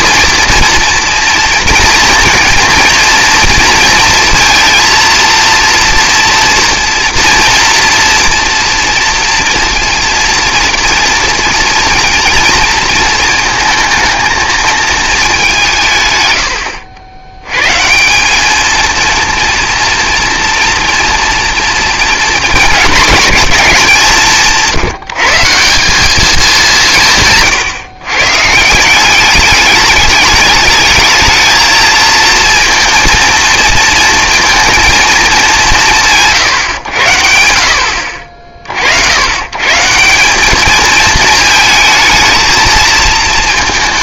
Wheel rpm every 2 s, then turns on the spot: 230, 230, 230, 230, 230, 230, 230, 220, 80, 220, 230, 220, 170, 180, 160, 210, 230, 230, 110, 60, 220, 220.
none